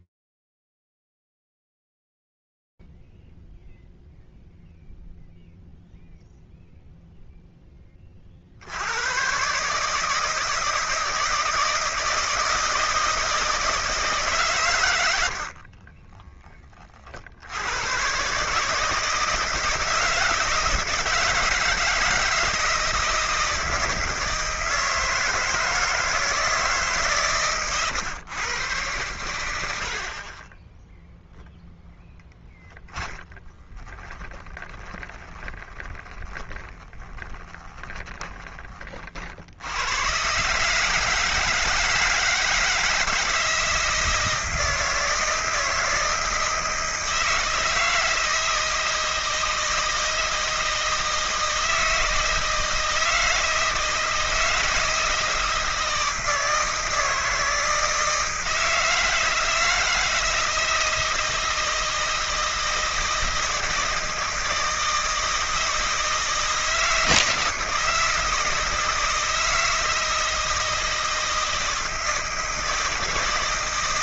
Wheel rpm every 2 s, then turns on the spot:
0, 0, 0, 0, 50, 150, 160, 130, 30, 150, 160, 160, 160, 160, 120, 20, 10, 10, 20, 20, 140, 160, 160, 160, 160, 160, 160, 160, 160, 160, 160, 160, 160, 160, 160, 160, 160.
32-38